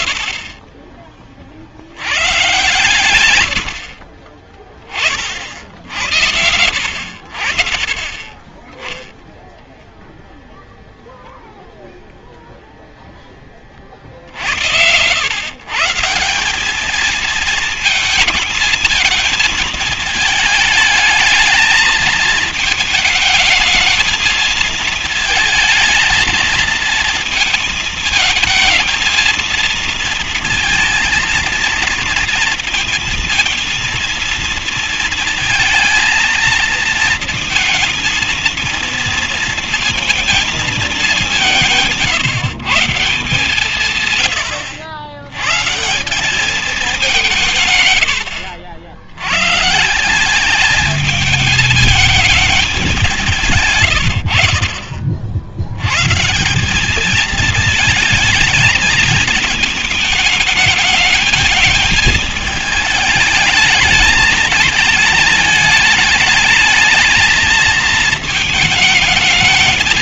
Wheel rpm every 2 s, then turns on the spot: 40, 130, 20, 80, 10, 0, 0, 90, 200, 230, 220, 220, 220, 220, 220, 220, 230, 230, 230, 230, 220, 150, 90, 200, 80, 210, 200, 60, 180, 220, 220, 220, 220, 220, 220.
none